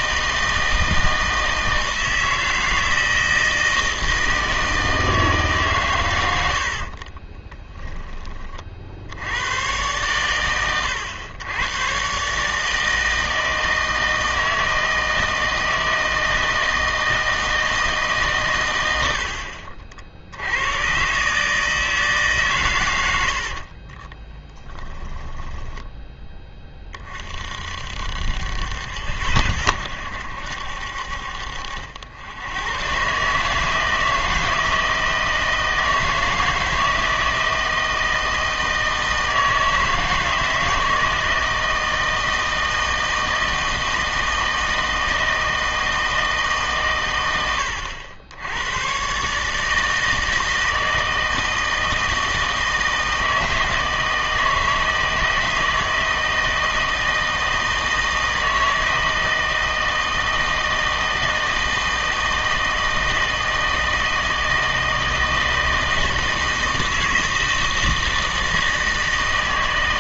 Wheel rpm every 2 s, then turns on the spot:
160, 160, 160, 60, 40, 100, 150, 160, 160, 110, 100, 130, 20, 20, 80, 70, 110, 160, 160, 160, 160, 160, 160, 150, 100, 160, 160, 160, 160, 160, 160, 160, 160, 160, 160.
6-8 24-26